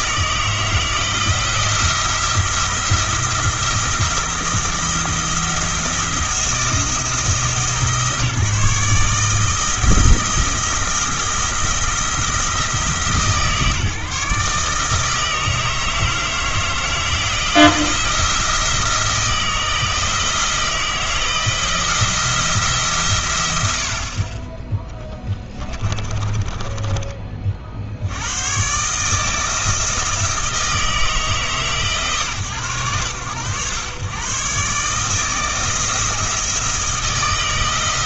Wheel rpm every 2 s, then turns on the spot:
160, 170, 170, 170, 150, 170, 160, 150, 160, 170, 160, 160, 10, 20, 130, 160, 100, 130, 160.
26-28